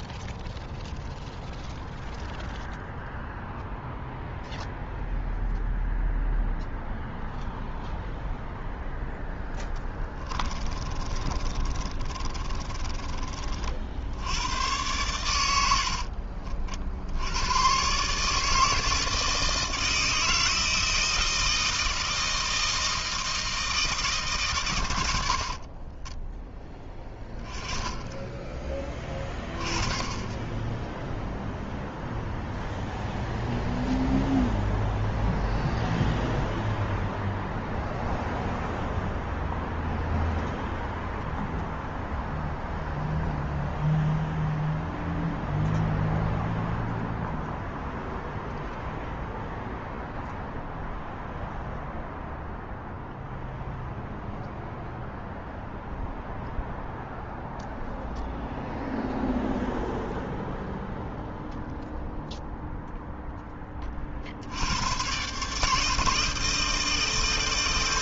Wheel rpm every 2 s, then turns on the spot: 0, 0, 0, 0, 0, 30, 40, 100, 90, 160, 160, 160, 70, 10, 20, 0, 0, 0, 0, 0, 0, 0, 0, 0, 0, 0, 0, 0, 0, 0, 0, 0, 130, 160.
10-12